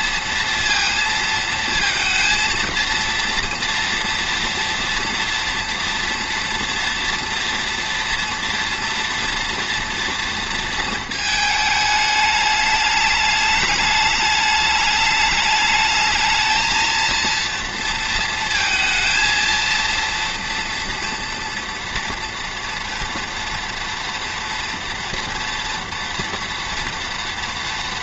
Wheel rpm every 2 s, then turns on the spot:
230, 230, 230, 240, 230, 220, 220, 210, 230, 230, 230, 230, 230, 230.
none